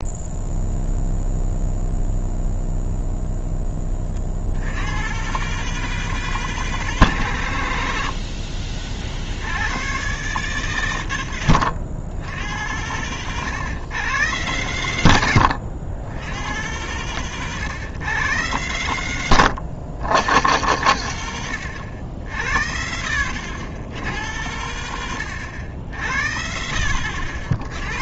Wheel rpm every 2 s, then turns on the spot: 0, 0, 70, 160, 50, 120, 90, 110, 100, 90, 90, 60, 80, 60.
22-24 26-28